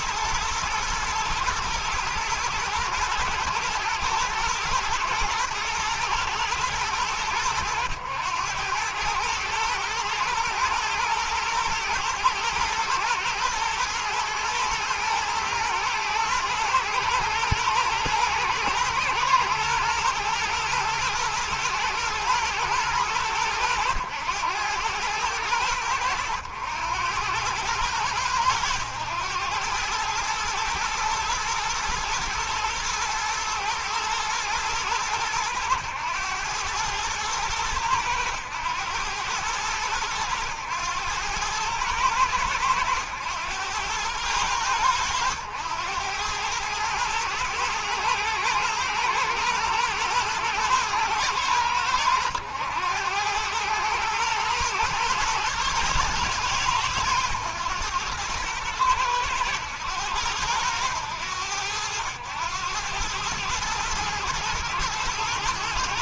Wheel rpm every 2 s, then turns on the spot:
110, 110, 110, 110, 110, 120, 120, 110, 110, 110, 120, 110, 110, 100, 100, 110, 110, 100, 110, 100, 110, 100, 90, 110, 110, 110, 100, 110, 100, 110, 100, 110, 110.
none